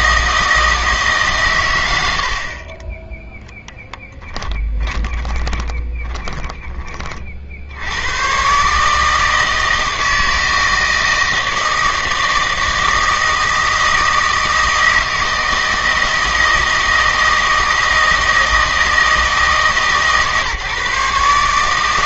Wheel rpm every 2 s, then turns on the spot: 160, 30, 10, 20, 140, 160, 160, 160, 160, 160, 150.
4-6